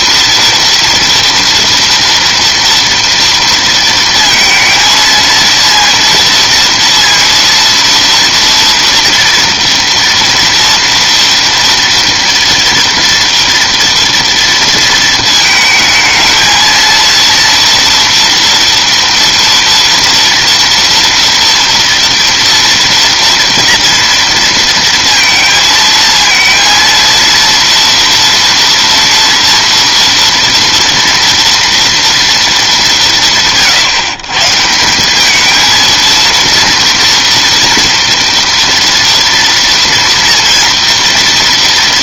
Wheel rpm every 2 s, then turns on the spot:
230, 230, 230, 230, 230, 240, 240, 220, 230, 230, 230, 230, 230, 230, 240, 230, 160, 220, 230, 230, 230.
none